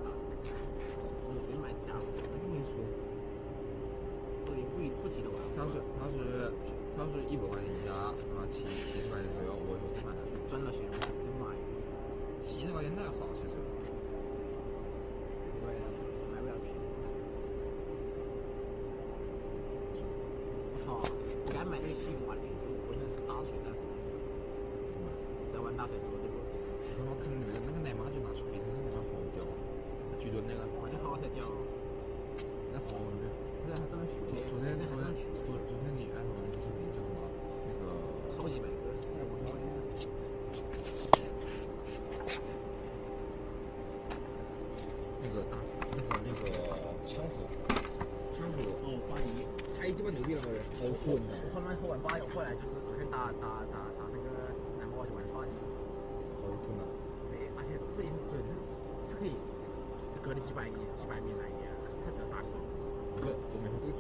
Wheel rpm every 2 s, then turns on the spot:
0, 0, 0, 0, 0, 0, 0, 0, 0, 0, 0, 0, 0, 0, 0, 0, 0, 0, 0, 0, 0, 0, 0, 0, 0, 0, 0, 0, 0, 0, 0, 0.
none